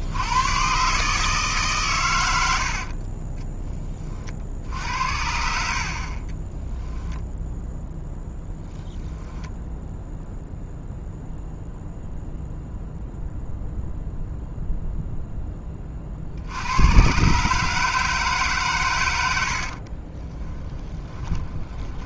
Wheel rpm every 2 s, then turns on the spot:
150, 20, 70, 0, 10, 0, 0, 10, 140, 80, 10.
4-6